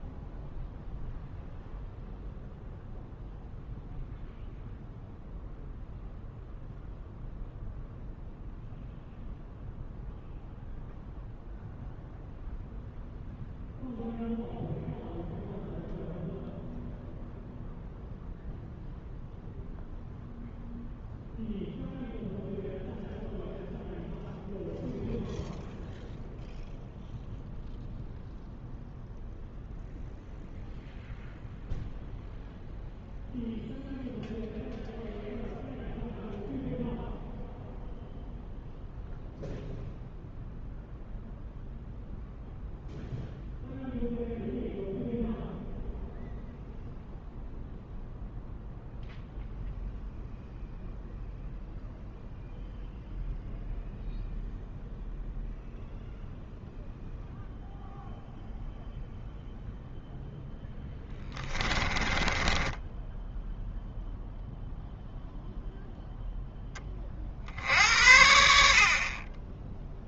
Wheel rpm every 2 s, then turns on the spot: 0, 0, 0, 0, 0, 0, 0, 0, 0, 0, 0, 0, 0, 0, 0, 0, 0, 0, 0, 0, 0, 0, 0, 0, 0, 0, 0, 0, 0, 0, 0, 10, 0, 20, 70.
62-64